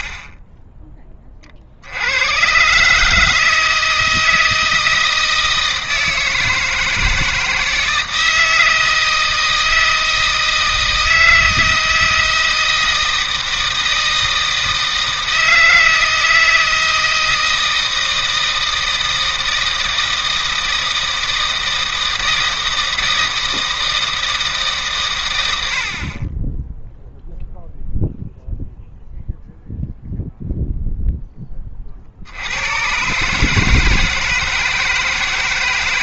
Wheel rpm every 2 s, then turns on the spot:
10, 120, 160, 160, 160, 160, 160, 160, 160, 160, 160, 160, 150, 10, 0, 0, 90, 160.
none